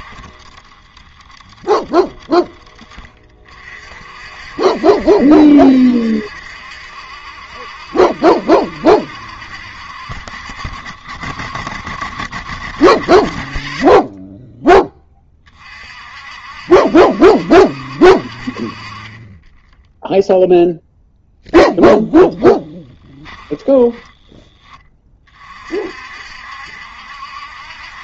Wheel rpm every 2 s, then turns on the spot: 10, 20, 60, 70, 70, 60, 60, 10, 60, 40, 0, 20, 20, 60.
22-24